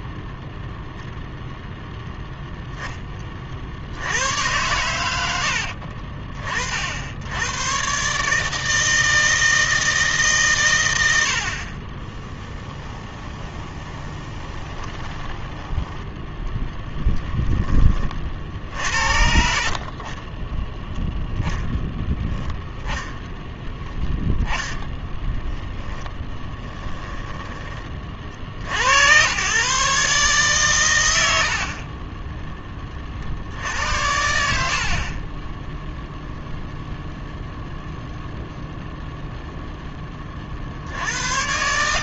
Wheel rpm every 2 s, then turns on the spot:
0, 10, 100, 70, 160, 120, 20, 20, 10, 70, 0, 0, 10, 10, 80, 100, 30, 50, 0, 0, 60.
12-16 18-20 24-28